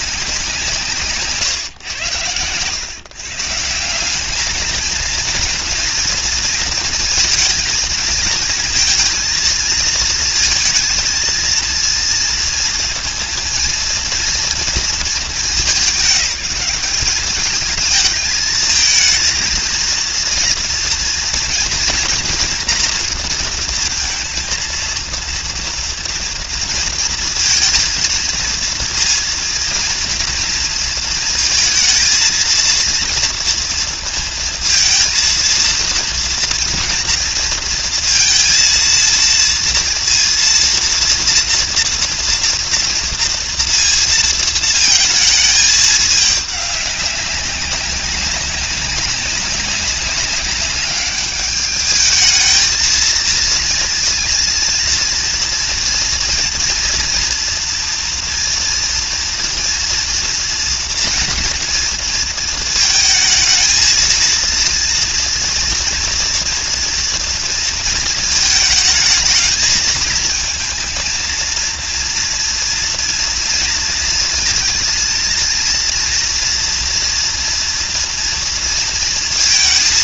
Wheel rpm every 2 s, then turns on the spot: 170, 110, 220, 230, 230, 220, 240, 230, 210, 220, 230, 230, 230, 230, 230, 230, 230, 220, 230, 230, 230, 230, 220, 200, 190, 200, 220, 230, 230, 230, 230, 230, 230, 230, 220, 220, 240, 230, 240, 230.
none